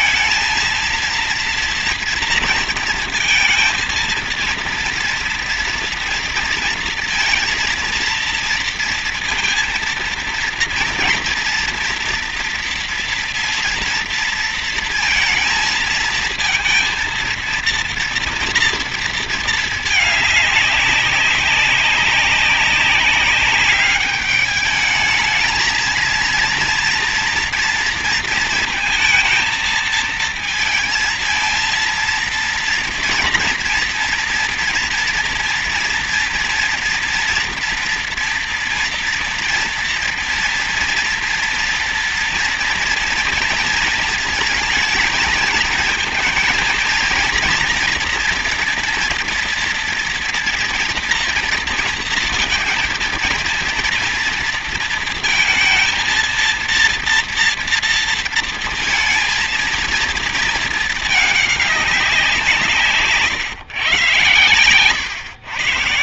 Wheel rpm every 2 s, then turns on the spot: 230, 230, 230, 230, 230, 230, 230, 230, 230, 230, 210, 190, 210, 230, 220, 230, 230, 230, 230, 230, 230, 230, 220, 230, 230, 230, 230, 230, 230, 230, 220, 170, 130.
none